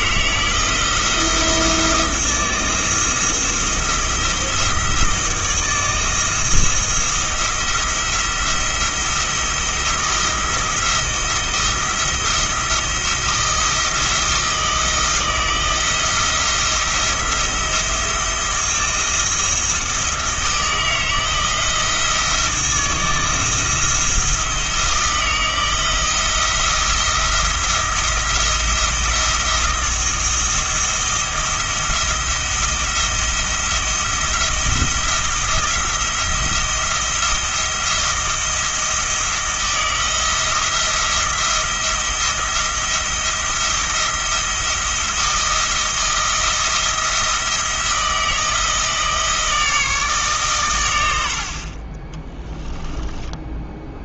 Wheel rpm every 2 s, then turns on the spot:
170, 170, 170, 170, 170, 170, 170, 170, 170, 170, 160, 160, 160, 170, 170, 170, 170, 170, 170, 160, 170, 170, 170, 170, 160, 110, 20.
52-54